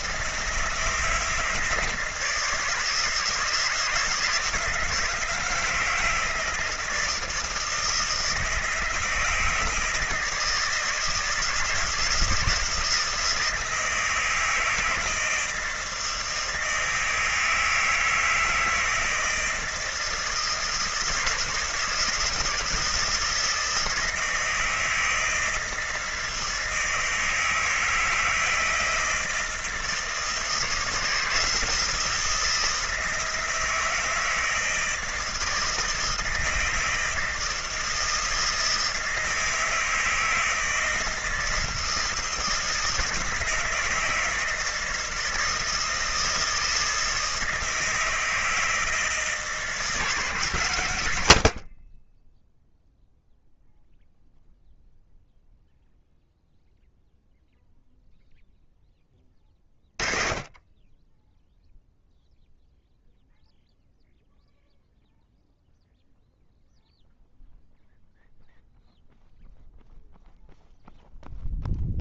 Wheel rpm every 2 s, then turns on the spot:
160, 160, 170, 160, 160, 170, 160, 160, 160, 160, 160, 160, 160, 160, 160, 160, 160, 160, 160, 160, 160, 160, 160, 160, 160, 130, 0, 0, 0, 10, 20, 0, 0, 0, 0, 0.
none